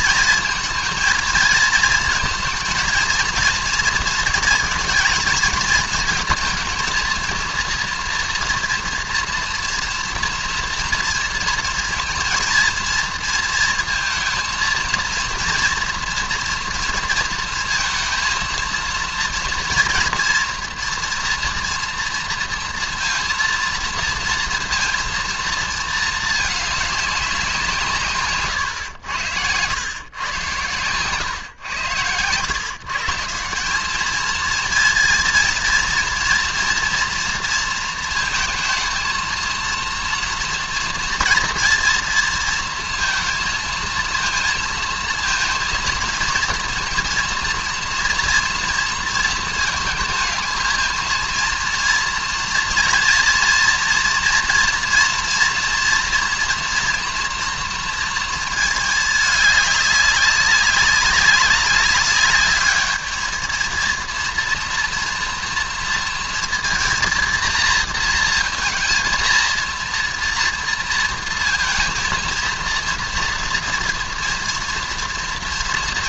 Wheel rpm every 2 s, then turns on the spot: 220, 230, 220, 230, 240, 230, 230, 230, 230, 230, 230, 230, 230, 220, 120, 120, 130, 220, 240, 230, 240, 230, 230, 230, 230, 220, 230, 230, 230, 220, 200, 210, 230, 230, 230, 230, 230, 230.
none